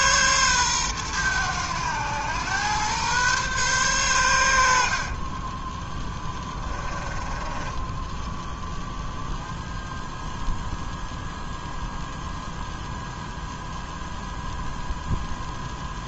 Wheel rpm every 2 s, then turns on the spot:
110, 120, 40, 20, 0, 0, 0, 0.
none